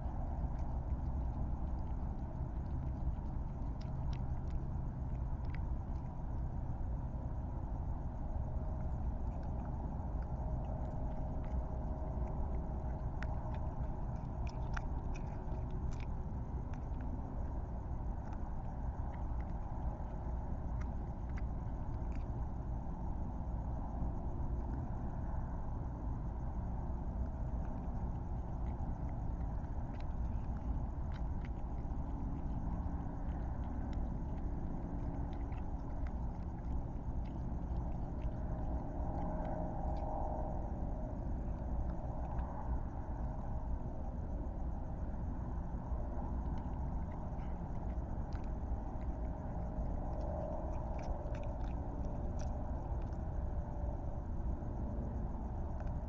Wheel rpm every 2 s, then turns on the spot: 0, 0, 0, 0, 0, 0, 0, 0, 0, 0, 0, 0, 0, 0, 0, 0, 0, 0, 0, 0, 0, 0, 0, 0, 0, 0, 0, 0.
none